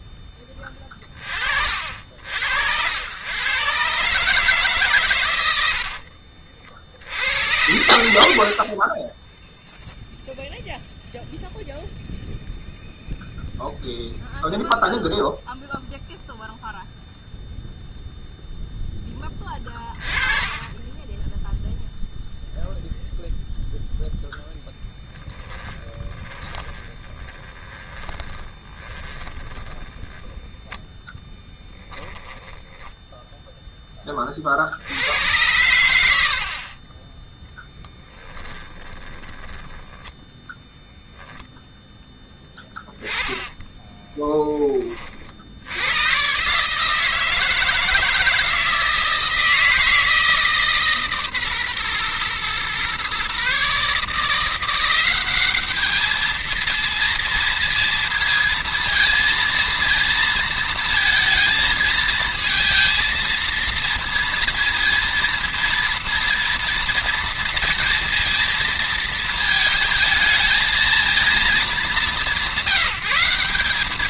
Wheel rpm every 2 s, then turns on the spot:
10, 90, 130, 60, 40, 0, 0, 0, 0, 10, 10, 0, 10, 20, 20, 10, 10, 70, 40, 10, 10, 10, 20, 150, 160, 150, 120, 180, 230, 230, 230, 230, 230, 230, 230, 230, 180.
24-30 32-34 36-40